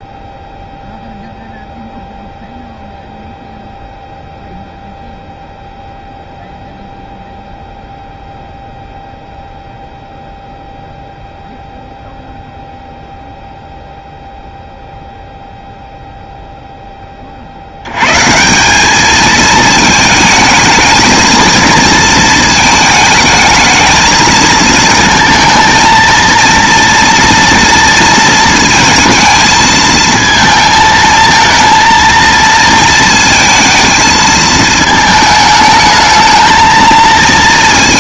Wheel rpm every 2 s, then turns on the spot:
0, 0, 0, 0, 0, 0, 0, 0, 0, 190, 220, 220, 220, 230, 230, 220, 230, 220, 220.
none